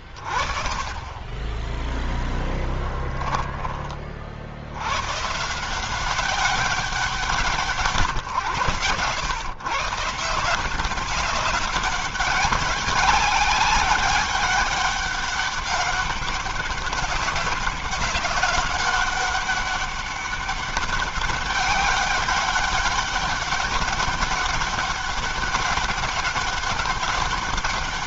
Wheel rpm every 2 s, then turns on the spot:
20, 10, 110, 190, 120, 190, 200, 200, 190, 200, 200, 200, 200, 200.
none